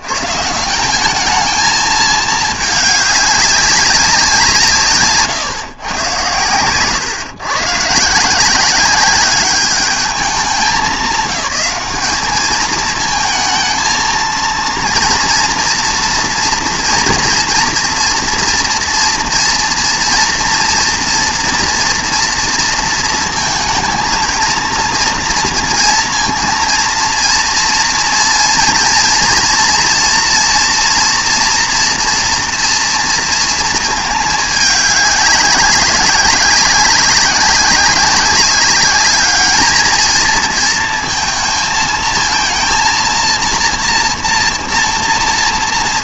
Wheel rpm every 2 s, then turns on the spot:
120, 210, 150, 120, 190, 190, 220, 230, 230, 240, 230, 230, 230, 230, 230, 230, 230, 210, 190, 210, 230, 230, 230.
none